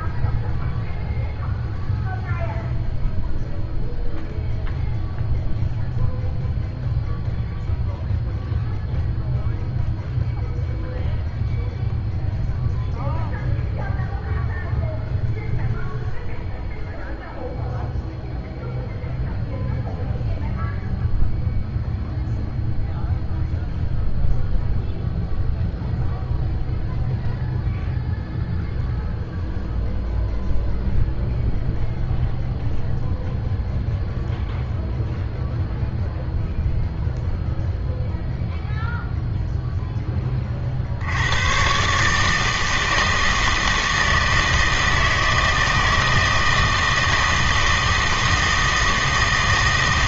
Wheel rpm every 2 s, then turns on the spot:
0, 0, 0, 0, 0, 0, 0, 0, 0, 0, 0, 0, 0, 0, 0, 0, 0, 0, 0, 0, 60, 160, 160, 160, 160.
none